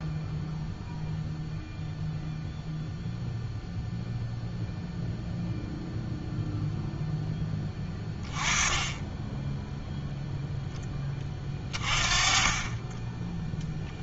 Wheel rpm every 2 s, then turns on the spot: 0, 0, 0, 0, 20, 10, 20.
none